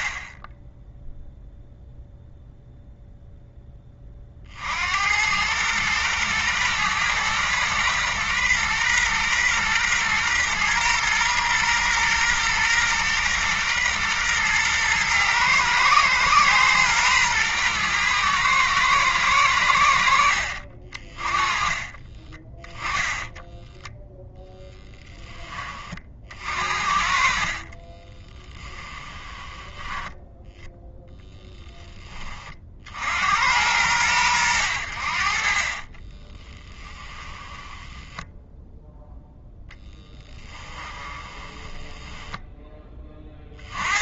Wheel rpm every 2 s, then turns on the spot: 20, 0, 40, 120, 120, 120, 120, 120, 120, 110, 60, 20, 0, 50, 20, 10, 30, 90, 20, 10, 10, 10.
22-24 28-30 36-42